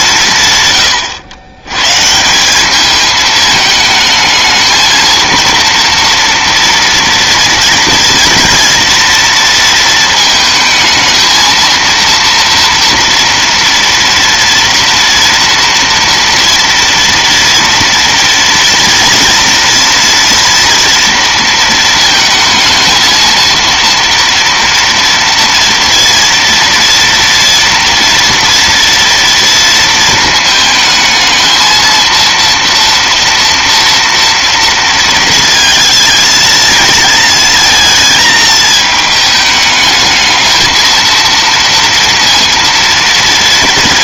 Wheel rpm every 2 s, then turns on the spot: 100, 220, 230, 230, 230, 230, 230, 230, 230, 230, 220, 230, 240, 240, 230, 220, 230, 220, 220, 210, 230, 230.
none